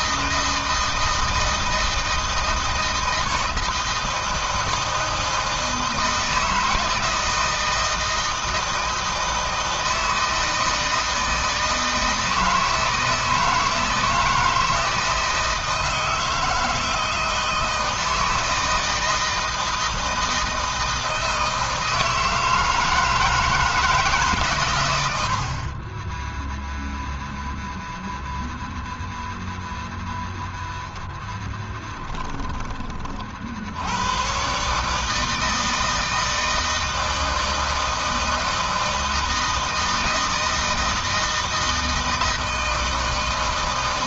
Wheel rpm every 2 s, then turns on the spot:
160, 160, 160, 160, 160, 160, 160, 160, 160, 160, 160, 160, 130, 10, 0, 0, 30, 130, 160, 160, 160, 160.
none